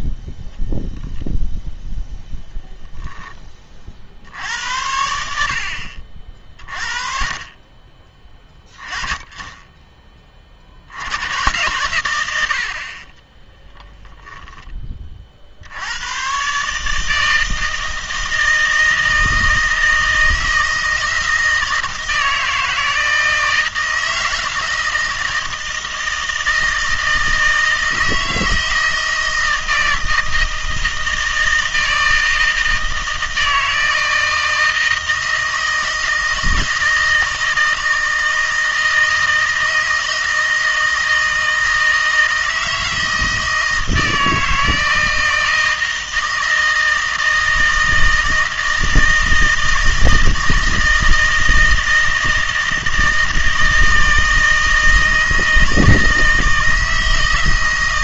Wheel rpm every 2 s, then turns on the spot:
0, 0, 80, 40, 20, 50, 70, 20, 140, 160, 160, 160, 160, 160, 160, 160, 160, 160, 160, 160, 160, 160, 160, 160, 160, 160, 160, 160, 160.
none